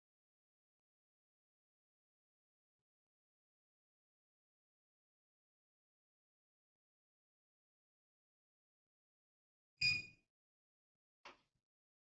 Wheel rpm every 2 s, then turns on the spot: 0, 0, 0, 0, 0, 0.
none